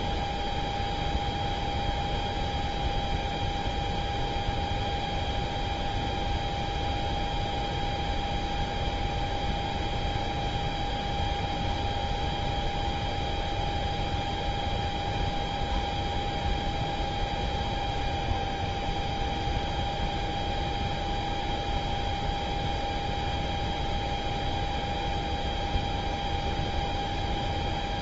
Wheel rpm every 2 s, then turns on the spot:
0, 0, 0, 0, 0, 0, 0, 0, 0, 0, 0, 0, 0, 0.
none